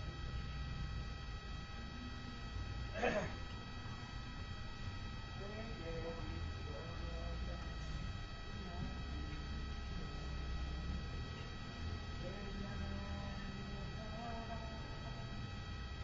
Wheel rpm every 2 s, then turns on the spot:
0, 0, 0, 0, 0, 0, 0, 0.
none